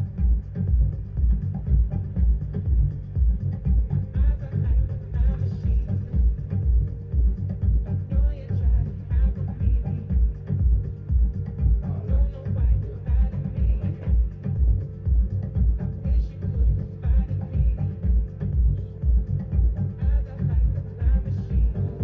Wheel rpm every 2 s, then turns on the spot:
0, 0, 0, 0, 0, 0, 0, 0, 0, 0, 0.
none